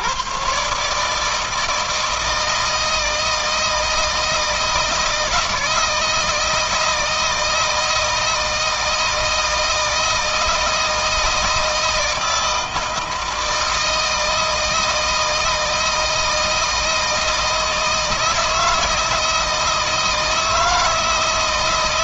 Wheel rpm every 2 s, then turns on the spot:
140, 160, 160, 160, 160, 160, 160, 160, 160, 160, 160.
none